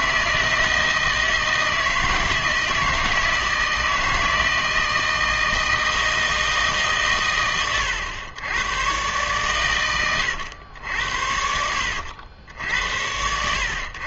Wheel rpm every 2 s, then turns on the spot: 160, 160, 160, 150, 110, 90, 90.
none